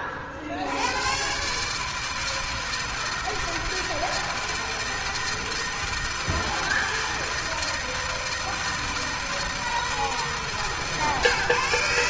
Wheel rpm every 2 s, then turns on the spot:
90, 160, 160, 160, 160, 140.
none